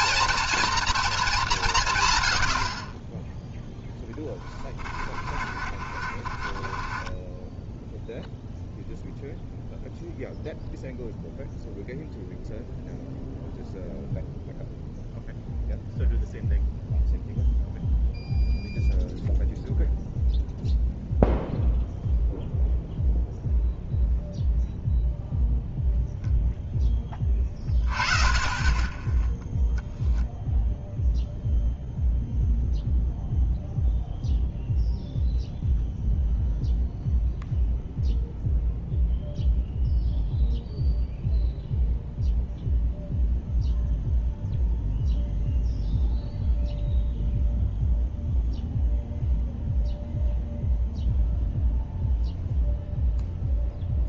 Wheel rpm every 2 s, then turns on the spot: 230, 70, 30, 30, 0, 0, 0, 0, 0, 0, 0, 0, 0, 0, 20, 0, 0, 0, 0, 0, 0, 0, 0, 0, 0, 0, 0.
4-8